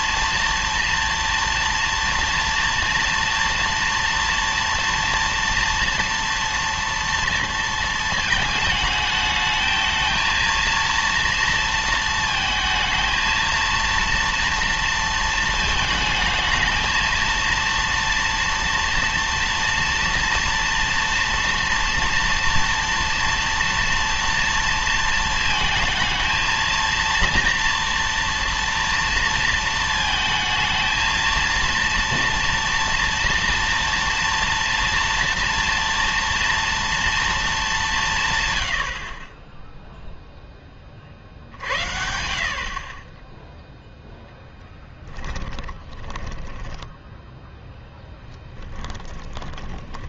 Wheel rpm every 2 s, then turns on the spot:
230, 230, 230, 230, 220, 230, 220, 230, 230, 230, 230, 240, 230, 230, 230, 230, 240, 230, 230, 110, 20, 40, 10, 10, 20.
44-46 48-50